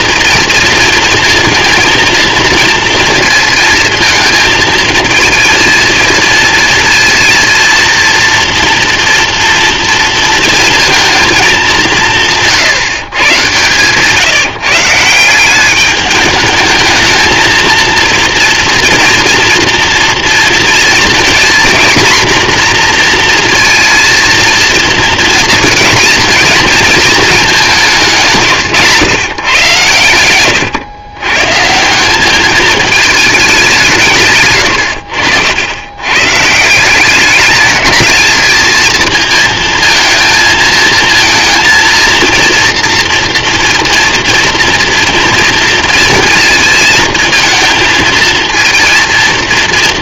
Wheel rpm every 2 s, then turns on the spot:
230, 230, 220, 230, 230, 230, 140, 150, 210, 230, 230, 240, 220, 230, 130, 120, 210, 110, 160, 220, 220, 230, 240, 230, 230.
none